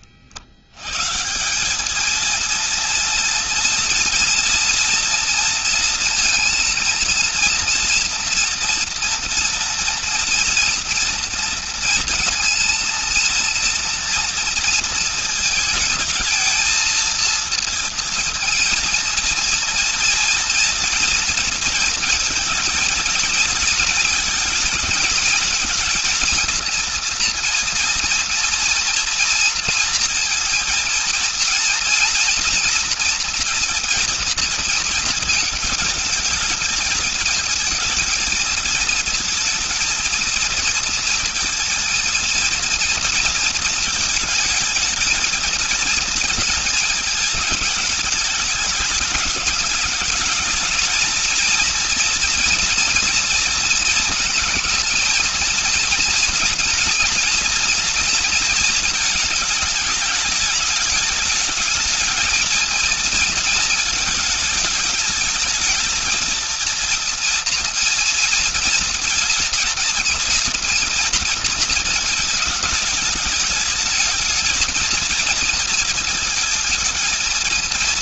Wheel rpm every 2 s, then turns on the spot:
110, 230, 230, 230, 230, 230, 230, 230, 230, 230, 230, 220, 220, 230, 230, 220, 230, 230, 230, 230, 230, 230, 220, 220, 210, 210, 240, 230, 240, 220, 210, 220, 210, 230, 230, 230, 220, 220, 220.
none